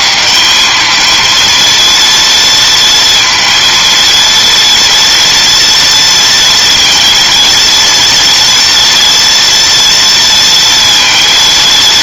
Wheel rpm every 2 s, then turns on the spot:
220, 230, 230, 230, 230, 230.
none